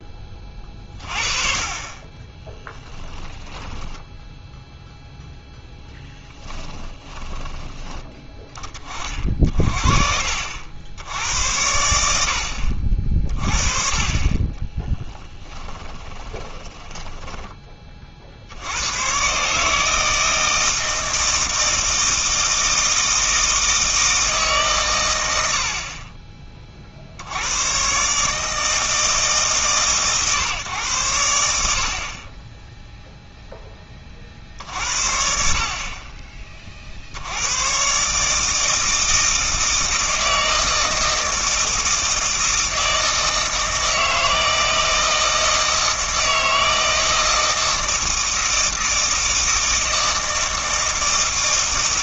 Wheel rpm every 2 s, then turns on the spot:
30, 10, 0, 10, 20, 70, 50, 20, 20, 80, 160, 160, 130, 40, 160, 130, 10, 60, 40, 160, 160, 160, 160, 160, 160, 160.
2-4 6-8 14-18